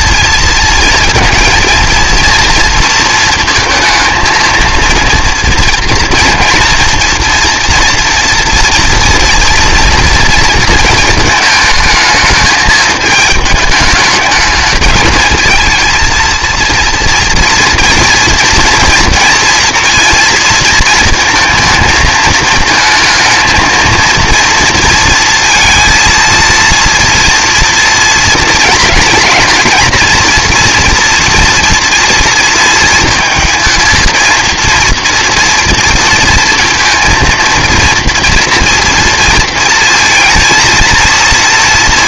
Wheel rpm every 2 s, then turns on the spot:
230, 230, 220, 230, 230, 230, 210, 210, 230, 230, 230, 220, 230, 230, 220, 230, 230, 230, 230, 230, 230.
none